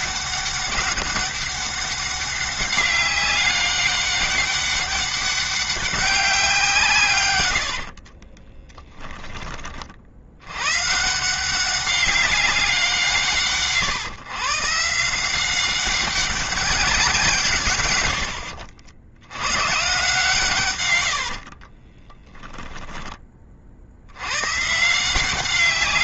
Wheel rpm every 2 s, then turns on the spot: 200, 200, 200, 150, 10, 130, 180, 160, 190, 80, 120, 10, 140.
20-22